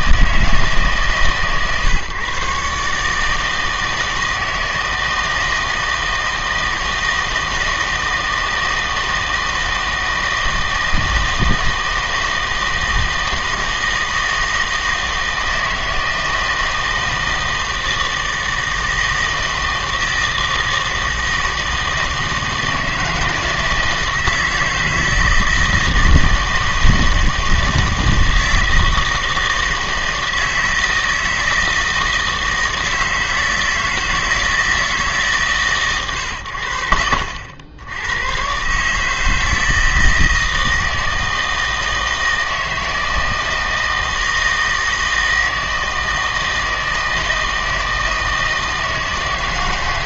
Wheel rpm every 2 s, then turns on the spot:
160, 140, 160, 160, 160, 160, 160, 160, 160, 160, 160, 160, 160, 160, 160, 160, 160, 160, 80, 130, 160, 160, 160, 160, 160.
none